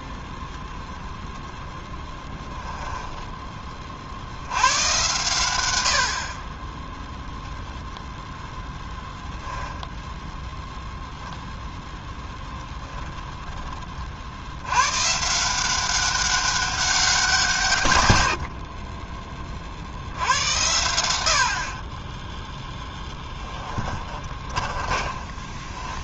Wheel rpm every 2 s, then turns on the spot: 0, 10, 100, 10, 10, 0, 0, 110, 190, 40, 100, 10, 20.
2-4 8-10 24-26